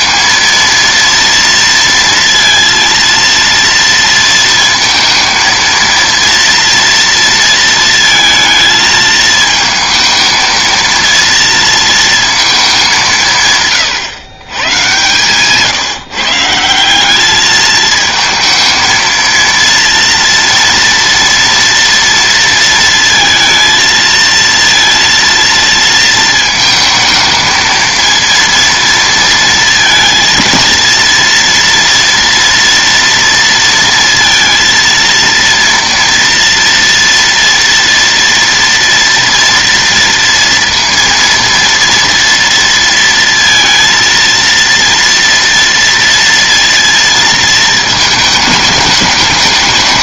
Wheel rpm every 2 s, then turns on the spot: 230, 230, 230, 230, 220, 230, 210, 120, 170, 220, 230, 230, 230, 220, 230, 230, 230, 230, 230, 230, 230, 230, 230, 230, 220.
none